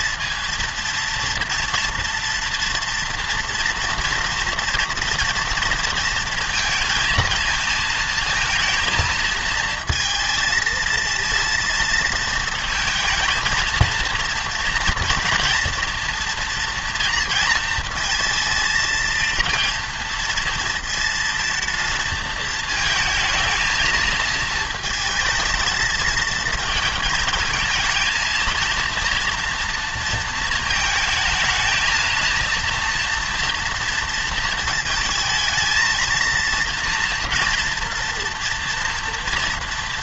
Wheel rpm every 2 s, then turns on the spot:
230, 230, 230, 220, 230, 230, 230, 230, 230, 220, 230, 220, 220, 220, 230, 220, 230, 220, 230, 230.
none